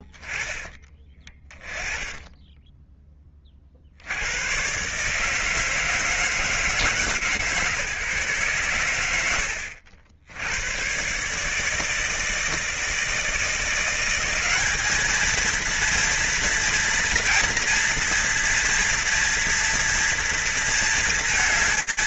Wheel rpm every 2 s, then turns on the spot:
10, 20, 80, 160, 140, 80, 160, 180, 230, 230, 230.
none